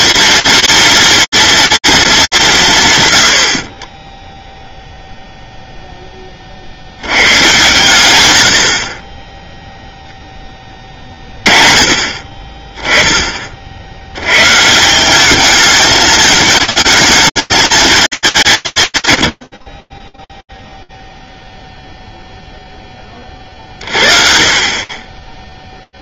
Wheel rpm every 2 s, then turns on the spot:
230, 140, 0, 100, 30, 20, 10, 170, 220, 150, 0, 10, 30.
none